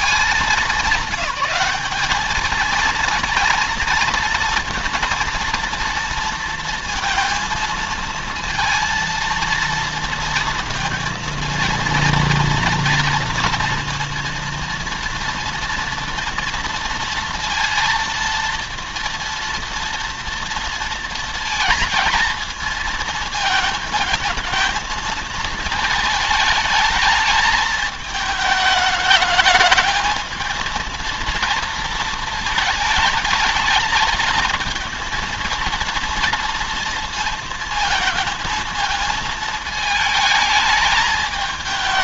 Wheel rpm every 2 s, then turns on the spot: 210, 220, 230, 230, 230, 230, 230, 230, 230, 230, 230, 230, 220, 220, 210, 230, 220, 220, 230, 220, 210.
none